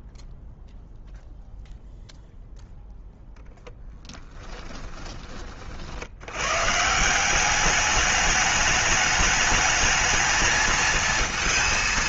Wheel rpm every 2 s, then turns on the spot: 0, 0, 10, 70, 200, 210.
4-6